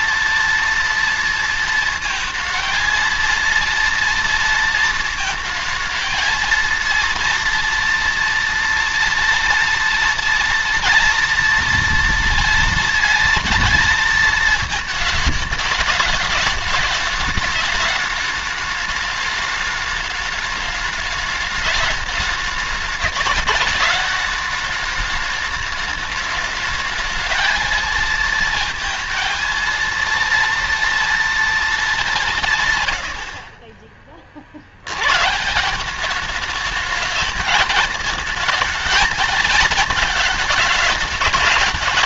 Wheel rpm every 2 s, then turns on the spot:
230, 230, 230, 230, 230, 230, 230, 220, 210, 210, 210, 210, 210, 220, 230, 230, 130, 100, 210, 230, 210.
none